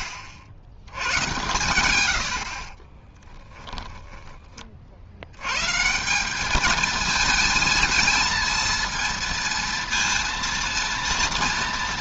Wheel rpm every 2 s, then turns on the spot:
80, 40, 40, 210, 230, 230.
2-4